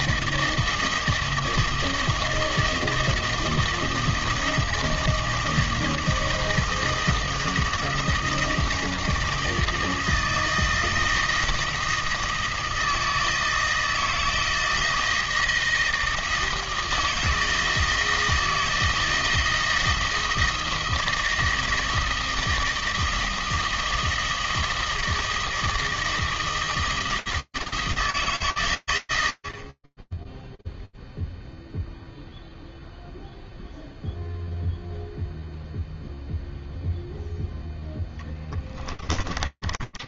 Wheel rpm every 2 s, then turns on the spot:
160, 160, 160, 160, 160, 160, 160, 160, 160, 160, 160, 160, 160, 160, 110, 0, 0, 0, 0, 20.
38-40